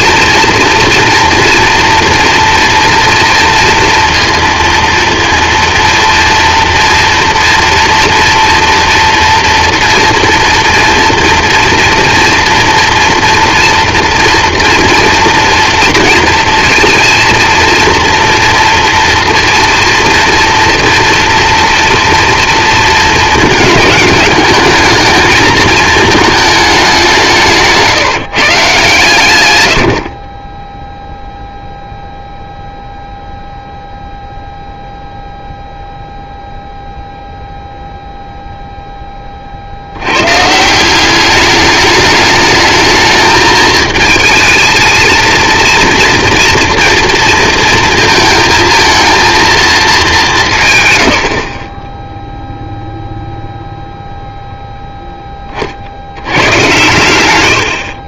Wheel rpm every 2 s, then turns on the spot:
230, 240, 230, 240, 230, 230, 230, 230, 230, 240, 230, 230, 220, 210, 140, 20, 0, 0, 0, 0, 150, 220, 220, 230, 230, 170, 0, 0, 110.
none